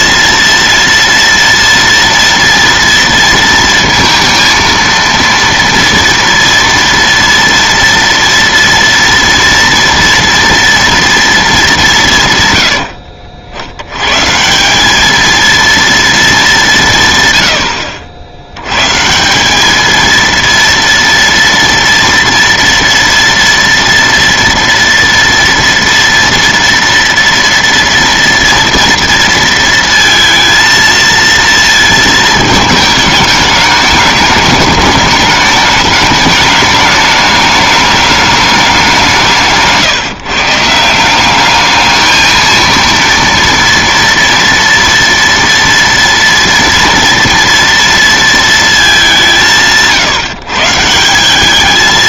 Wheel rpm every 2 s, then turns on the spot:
230, 230, 230, 230, 230, 230, 100, 180, 190, 90, 230, 230, 230, 230, 230, 230, 210, 210, 210, 200, 150, 230, 230, 230, 220, 160.
none